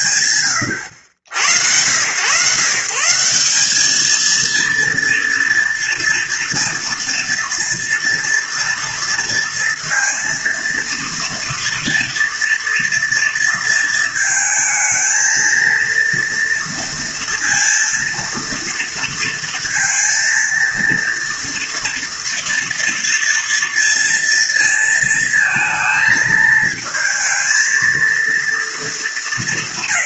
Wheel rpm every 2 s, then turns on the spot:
100, 170, 230, 230, 230, 230, 230, 220, 230, 230, 230, 230, 230, 230, 220.
none